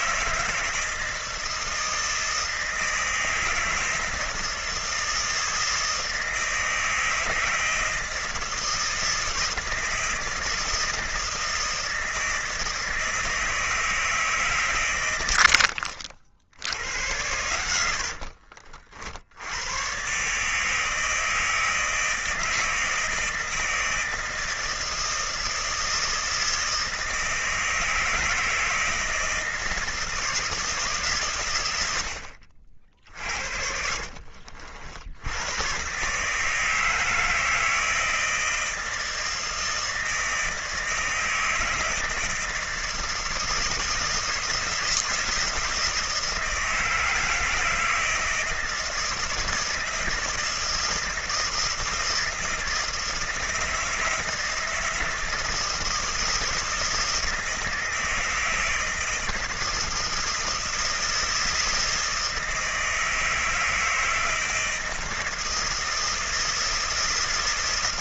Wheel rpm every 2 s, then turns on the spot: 160, 160, 160, 160, 160, 160, 160, 130, 80, 60, 150, 160, 160, 160, 160, 150, 50, 50, 160, 160, 160, 170, 160, 160, 160, 160, 160, 160, 160, 160, 160, 160, 160, 160.
32-34